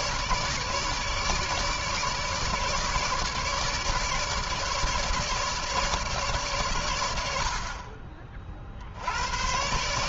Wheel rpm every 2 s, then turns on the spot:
150, 150, 150, 100, 70.
none